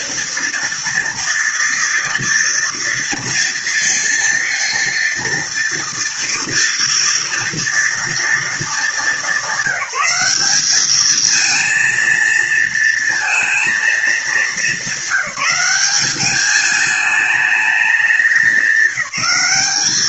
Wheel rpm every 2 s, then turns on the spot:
230, 230, 230, 230, 220, 210, 230, 200, 210, 190.
none